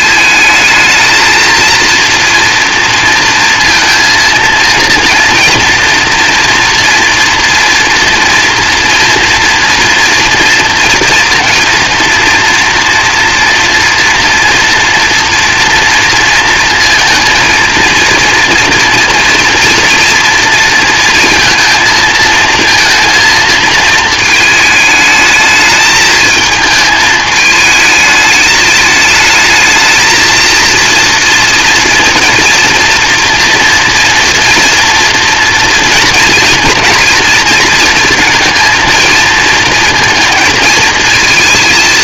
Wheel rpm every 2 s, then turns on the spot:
220, 230, 230, 230, 230, 230, 230, 230, 230, 230, 230, 230, 220, 220, 210, 230, 230, 230, 230, 230, 230.
none